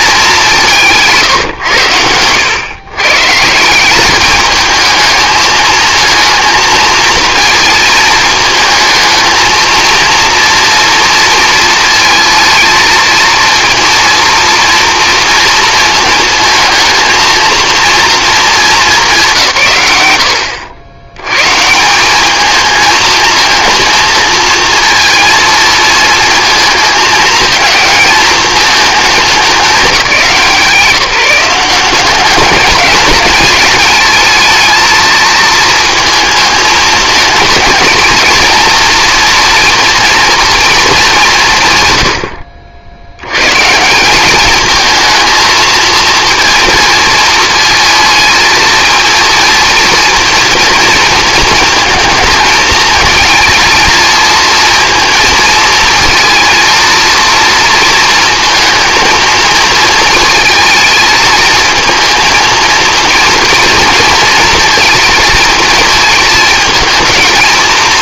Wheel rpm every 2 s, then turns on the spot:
180, 100, 210, 230, 220, 230, 220, 230, 220, 220, 90, 220, 230, 220, 220, 180, 200, 220, 230, 230, 230, 60, 210, 230, 220, 230, 220, 230, 230, 230, 220, 220, 230, 220.
none